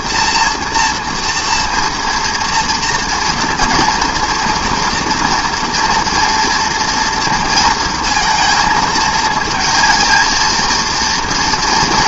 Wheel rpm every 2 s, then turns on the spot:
240, 230, 240, 230, 230, 230.
none